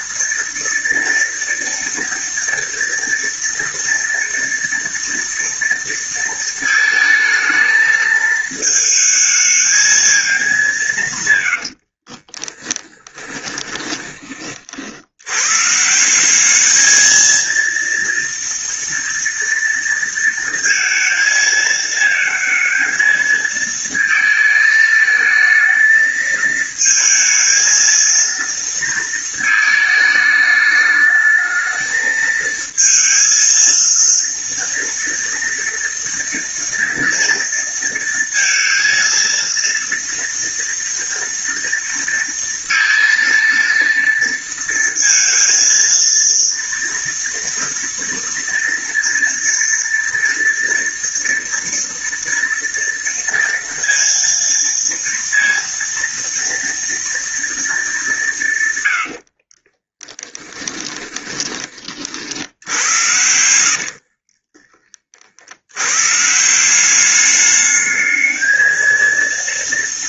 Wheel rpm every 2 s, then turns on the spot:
230, 230, 230, 220, 220, 210, 20, 40, 200, 230, 230, 220, 220, 220, 230, 210, 220, 230, 230, 230, 230, 230, 230, 230, 230, 230, 230, 230, 230, 150, 10, 70, 30, 150, 220.
12-14 60-62 64-66